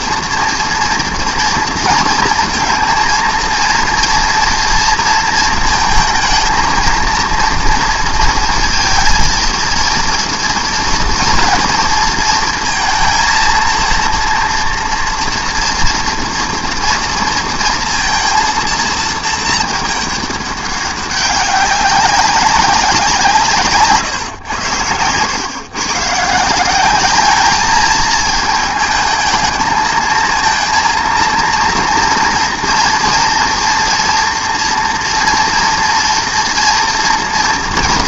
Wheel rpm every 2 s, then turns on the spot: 230, 230, 230, 220, 230, 230, 230, 230, 230, 230, 200, 190, 100, 180, 220, 230, 230, 240, 230.
none